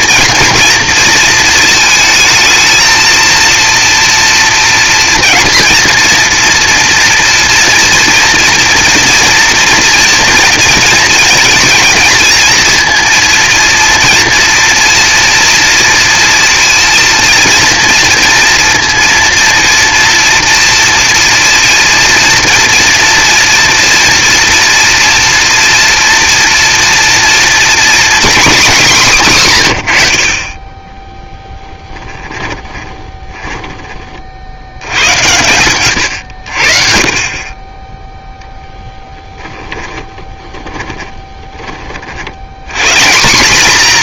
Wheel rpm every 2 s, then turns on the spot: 230, 220, 230, 230, 230, 230, 220, 230, 230, 240, 230, 230, 240, 240, 240, 80, 10, 40, 100, 10, 30, 110.
32-34 40-42